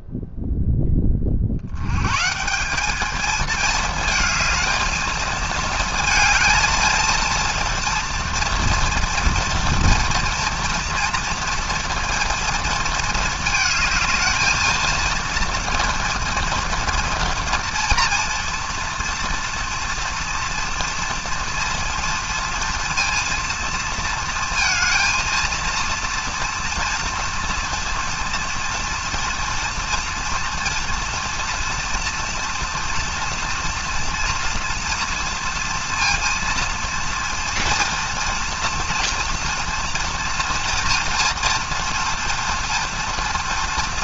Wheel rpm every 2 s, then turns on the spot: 0, 170, 220, 230, 240, 230, 230, 220, 230, 230, 230, 230, 230, 240, 230, 230, 230, 230, 230, 240, 230, 230.
none